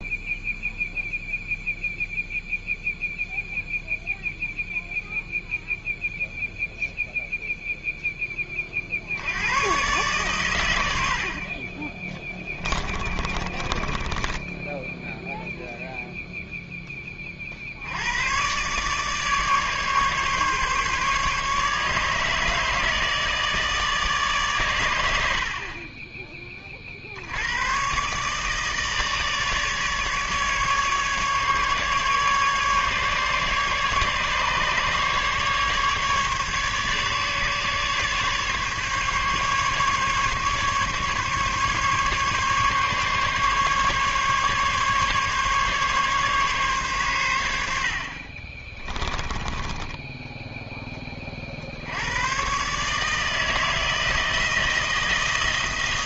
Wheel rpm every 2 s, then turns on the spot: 0, 0, 0, 0, 40, 100, 30, 10, 10, 140, 140, 160, 110, 50, 150, 150, 140, 150, 150, 140, 140, 140, 140, 130, 20, 10, 150, 160.
12-16 48-50